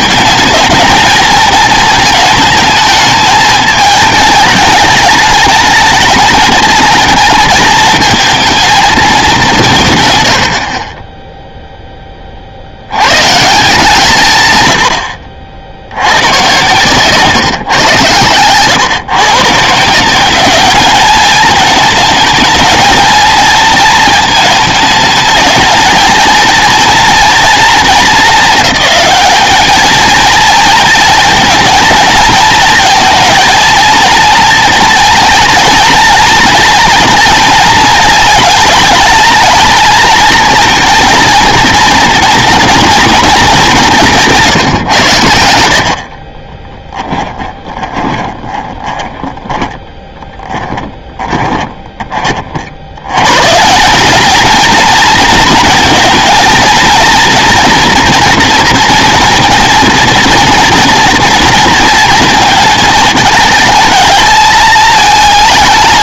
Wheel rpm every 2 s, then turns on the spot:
230, 220, 210, 210, 230, 50, 70, 110, 130, 110, 210, 220, 220, 230, 220, 230, 220, 220, 230, 220, 220, 230, 150, 20, 20, 20, 70, 220, 230, 230, 230, 220, 220.
46-52